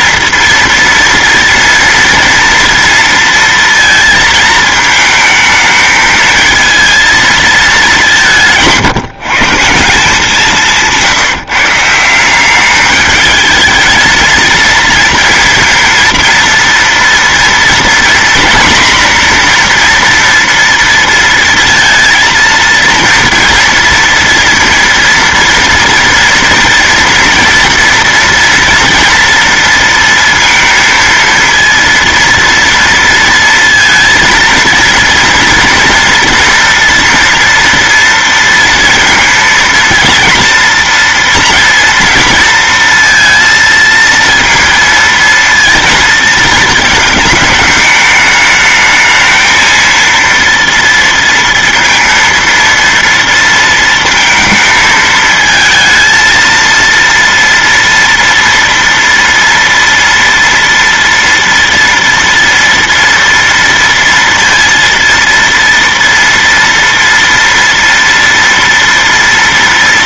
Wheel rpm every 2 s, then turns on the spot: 230, 230, 220, 230, 160, 170, 210, 230, 230, 240, 230, 230, 230, 230, 230, 230, 230, 230, 230, 230, 230, 230, 230, 220, 220, 230, 230, 220, 230, 230, 230, 230, 230, 230, 230.
none